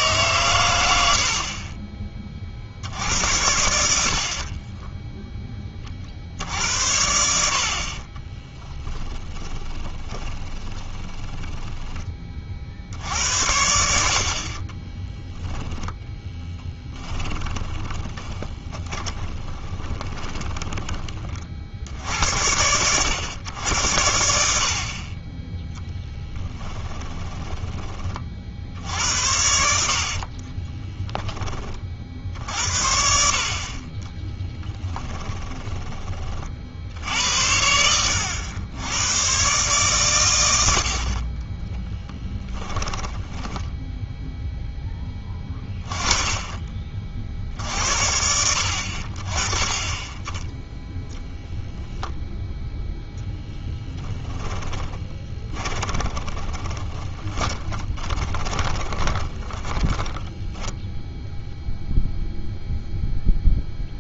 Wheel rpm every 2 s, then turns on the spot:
100, 70, 20, 70, 10, 20, 50, 40, 20, 20, 20, 80, 60, 10, 60, 10, 60, 10, 50, 90, 80, 10, 10, 20, 70, 10, 0, 20, 20, 20, 10, 0.
8-12 14-22 26-28 30-32 34-36 42-44 54-62